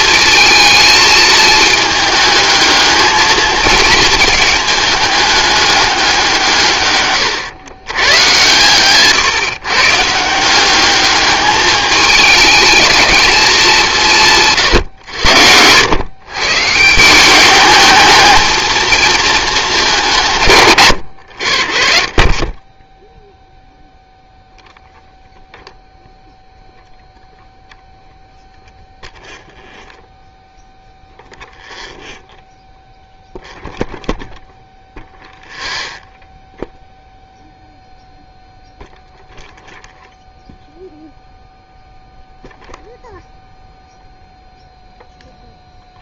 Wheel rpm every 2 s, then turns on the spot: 220, 220, 210, 130, 130, 200, 220, 120, 170, 220, 110, 0, 0, 0, 0, 0, 0, 0, 0, 0, 0, 0, 0.
8-10